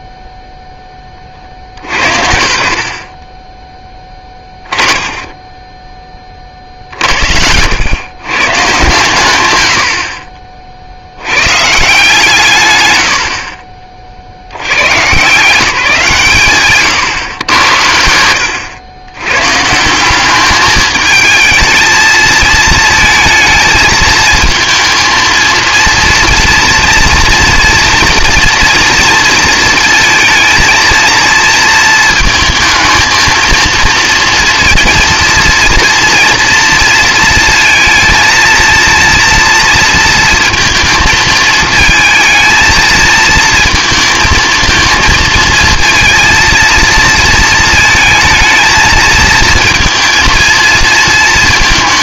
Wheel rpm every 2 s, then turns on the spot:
0, 60, 20, 60, 130, 40, 120, 110, 130, 100, 210, 220, 230, 230, 230, 230, 220, 230, 230, 230, 230, 230, 230, 230, 220, 230.
4-6